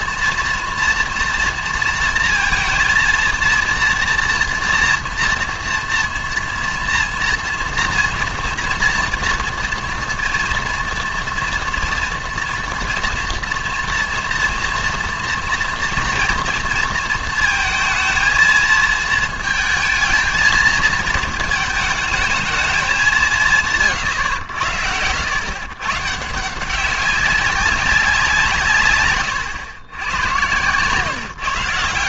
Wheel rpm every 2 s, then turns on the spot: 230, 230, 230, 230, 230, 230, 230, 230, 230, 220, 230, 220, 80, 170, 150, 120.
none